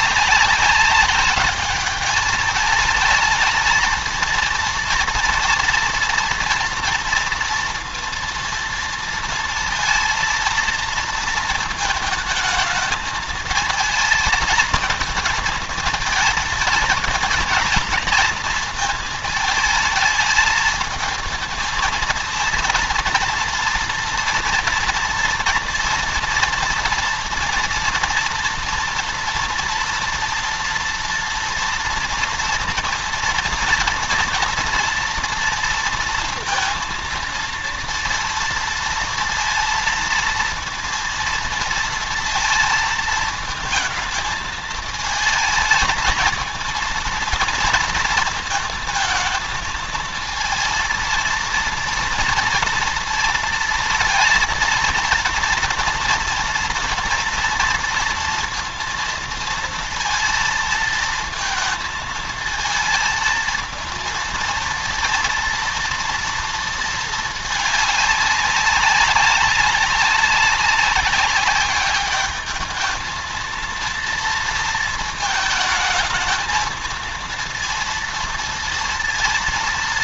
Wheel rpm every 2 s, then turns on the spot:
200, 210, 230, 230, 230, 230, 220, 220, 230, 220, 220, 230, 230, 230, 230, 230, 240, 230, 230, 230, 230, 230, 220, 230, 230, 230, 230, 230, 230, 230, 230, 220, 230, 230, 200, 200, 220, 230, 220, 230.
none